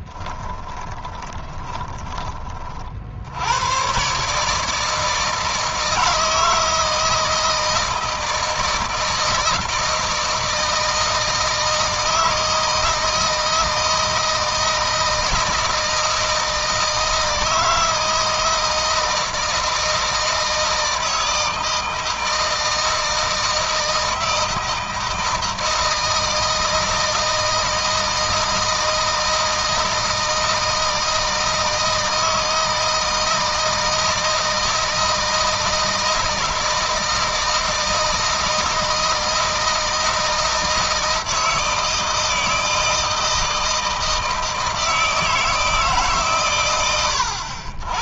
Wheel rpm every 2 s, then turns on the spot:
30, 50, 160, 160, 160, 160, 160, 160, 170, 160, 160, 160, 160, 160, 160, 160, 160, 160, 160, 160, 160, 160, 160, 100.
0-2